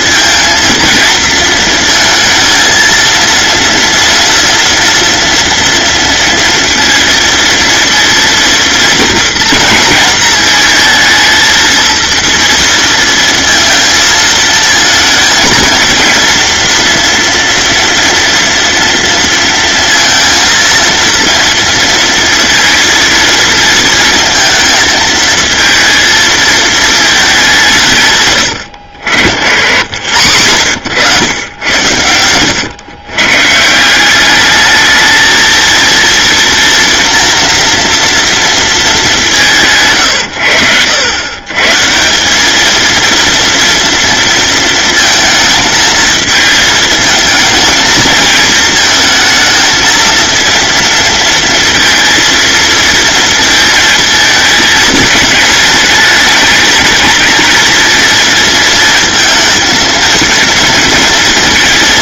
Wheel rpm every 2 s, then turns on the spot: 230, 230, 230, 230, 230, 230, 230, 230, 230, 230, 230, 230, 220, 210, 80, 100, 130, 220, 230, 190, 100, 230, 220, 220, 220, 230, 230, 220, 220, 220, 230.
none